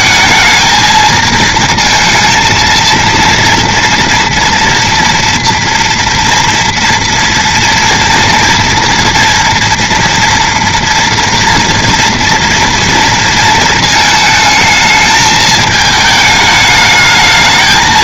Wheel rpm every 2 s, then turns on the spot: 220, 230, 230, 230, 230, 230, 230, 220, 220.
none